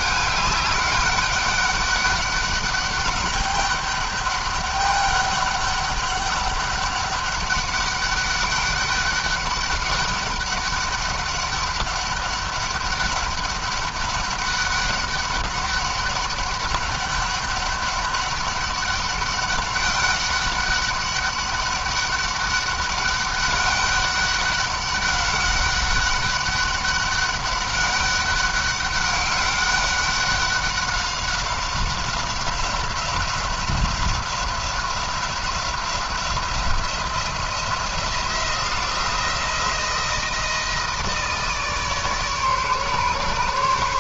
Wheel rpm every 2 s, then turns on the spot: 200, 200, 200, 200, 200, 200, 200, 200, 200, 200, 190, 200, 200, 200, 200, 190, 180, 180, 170, 170, 160, 150.
none